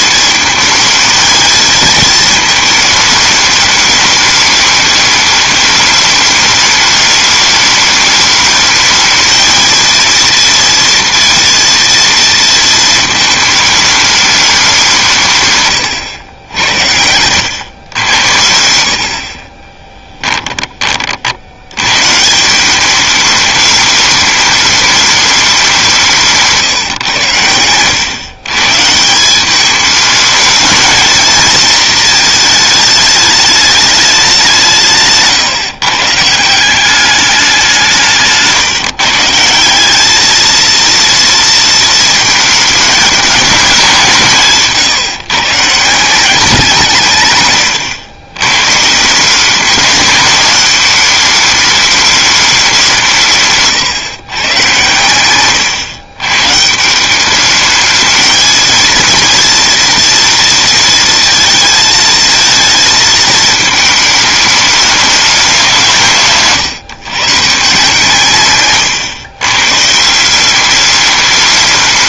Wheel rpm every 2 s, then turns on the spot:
220, 220, 210, 210, 210, 230, 230, 200, 80, 80, 30, 180, 210, 150, 140, 220, 220, 180, 170, 160, 220, 220, 160, 180, 130, 210, 200, 120, 140, 220, 230, 220, 210, 140, 130, 190.
68-70